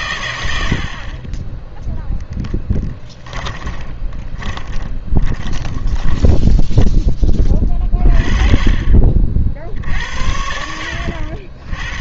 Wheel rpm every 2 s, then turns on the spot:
80, 10, 10, 10, 30, 70.
2-8